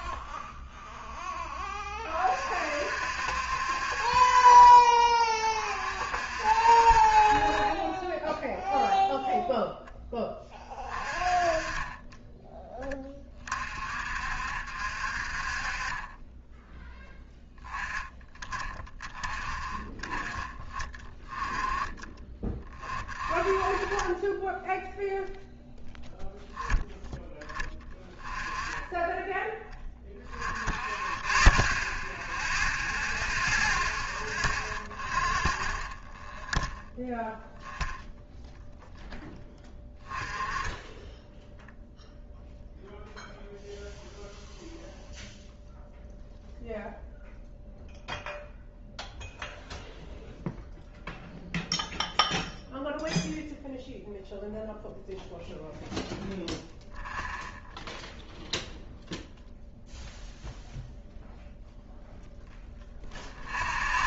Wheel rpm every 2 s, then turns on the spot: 0, 50, 30, 50, 0, 20, 10, 50, 10, 20, 20, 30, 0, 0, 10, 20, 0, 0, 0, 0, 10, 0, 0, 0, 0, 0, 0, 0, 0, 0, 0, 0.
none